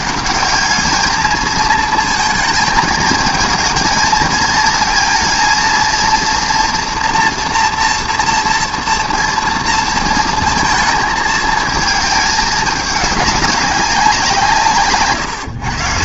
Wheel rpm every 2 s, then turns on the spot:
200, 220, 220, 230, 240, 220, 210, 150.
none